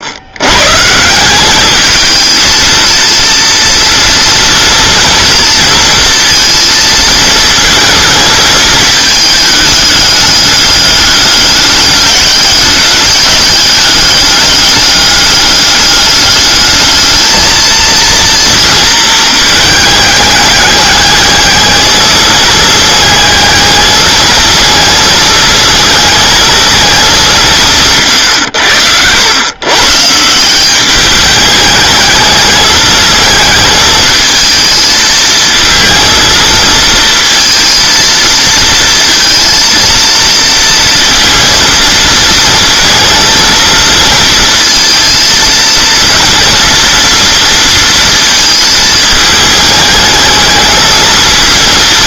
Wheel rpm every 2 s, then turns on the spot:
140, 230, 230, 230, 220, 210, 200, 200, 210, 230, 210, 220, 220, 220, 100, 190, 220, 220, 220, 230, 230, 220, 230, 230, 220, 220.
none